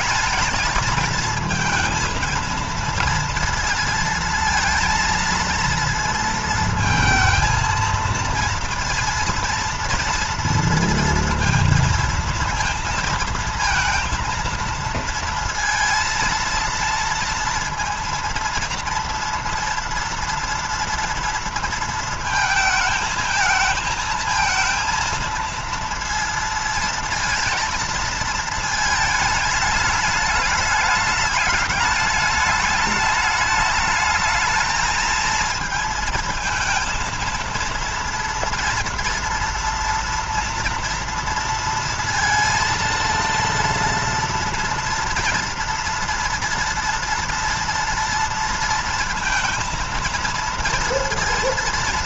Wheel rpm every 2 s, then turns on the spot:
220, 220, 230, 230, 230, 230, 230, 230, 230, 230, 230, 220, 220, 230, 220, 220, 210, 220, 230, 230, 240, 230, 230, 230, 230, 230.
none